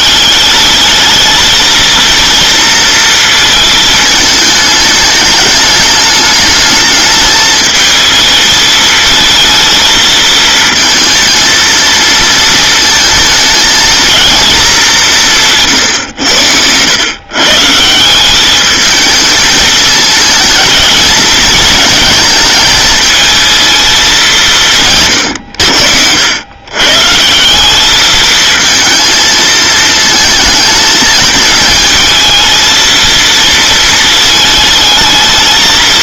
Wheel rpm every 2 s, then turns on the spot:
200, 230, 210, 220, 220, 220, 230, 220, 100, 200, 220, 220, 170, 120, 220, 220, 220, 220.
none